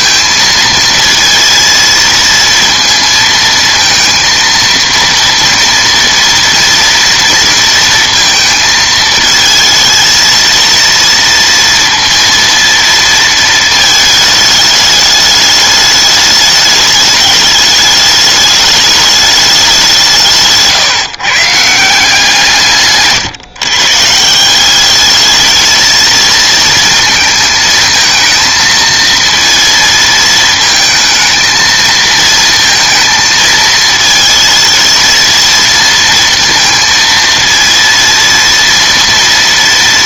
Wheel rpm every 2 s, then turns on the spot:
230, 230, 230, 230, 220, 230, 230, 210, 210, 210, 150, 160, 190, 220, 230, 230, 230, 220, 230, 230.
none